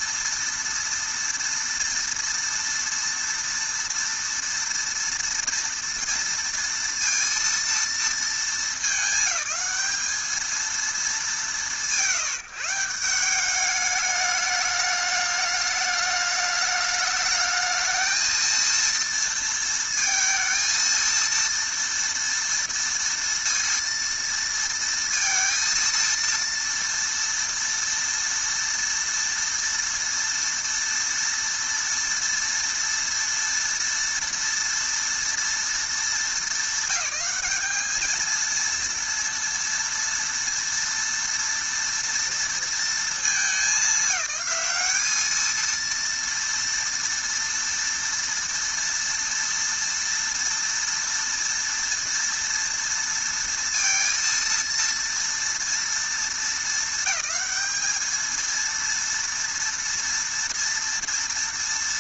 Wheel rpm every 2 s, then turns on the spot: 230, 230, 230, 230, 220, 220, 160, 210, 210, 230, 230, 230, 230, 230, 230, 230, 230, 230, 210, 230, 230, 230, 200, 230, 230, 230, 230, 230, 220, 230, 230.
none